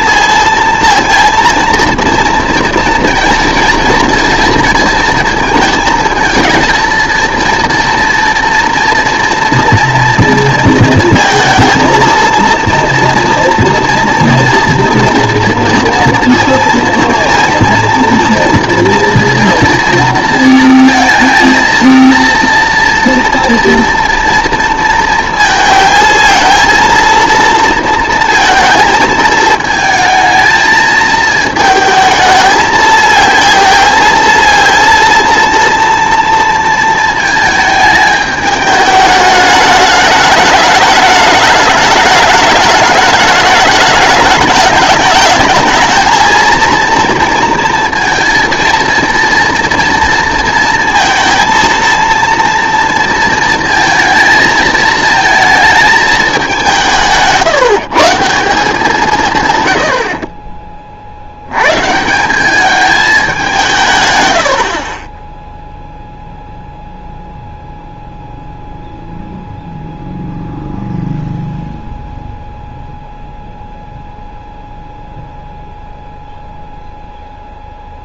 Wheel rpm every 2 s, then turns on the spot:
230, 230, 230, 230, 230, 230, 230, 230, 230, 230, 230, 230, 230, 230, 220, 220, 220, 230, 230, 210, 210, 210, 210, 230, 230, 220, 230, 220, 190, 180, 40, 200, 70, 0, 0, 0, 0, 0, 0.
64-66